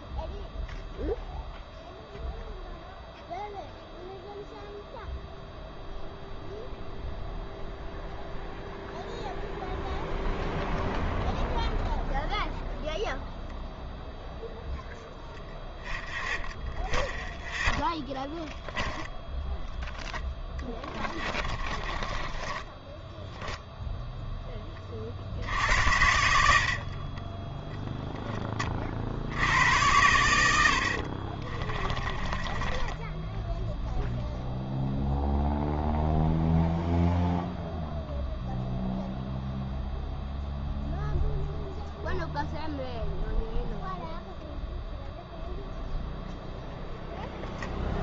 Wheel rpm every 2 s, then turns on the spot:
0, 0, 0, 0, 0, 0, 0, 0, 0, 0, 20, 20, 20, 70, 30, 70, 10, 0, 0, 0, 0, 0, 0, 0.
20-24 30-34